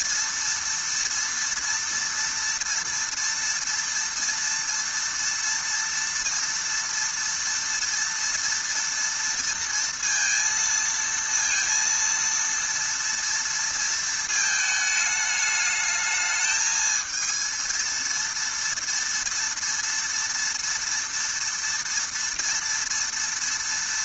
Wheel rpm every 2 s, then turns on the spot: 230, 230, 230, 230, 230, 230, 230, 220, 220, 230, 230, 230.
none